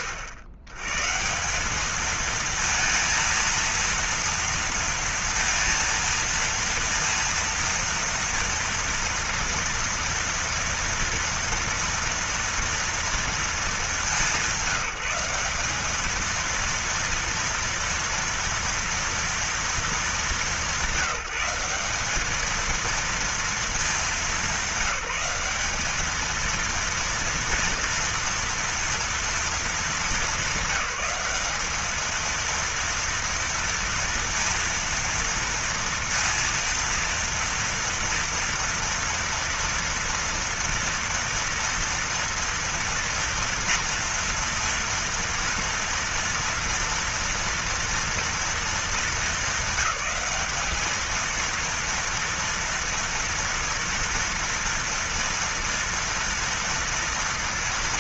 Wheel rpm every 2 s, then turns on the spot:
100, 230, 230, 230, 230, 230, 240, 180, 230, 230, 180, 230, 200, 230, 230, 190, 230, 230, 230, 230, 230, 230, 230, 230, 220, 210, 230, 230, 230.
none